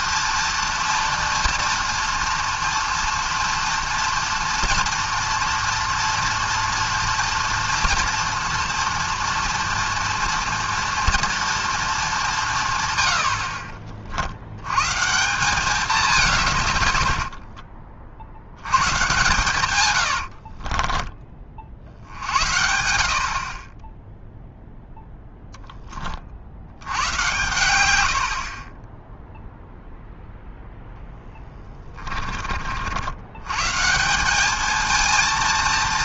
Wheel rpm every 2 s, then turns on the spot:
230, 230, 240, 230, 230, 230, 140, 110, 120, 110, 40, 80, 0, 80, 30, 0, 50, 220.
20-22